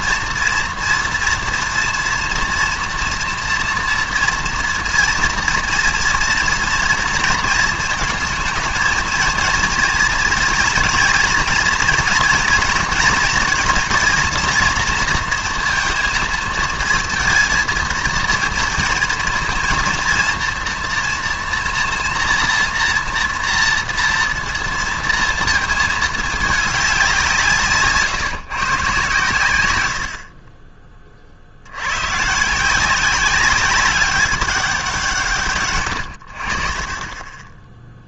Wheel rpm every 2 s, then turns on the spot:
230, 230, 230, 230, 220, 230, 230, 230, 220, 230, 230, 230, 230, 210, 150, 30, 160, 190, 50.
none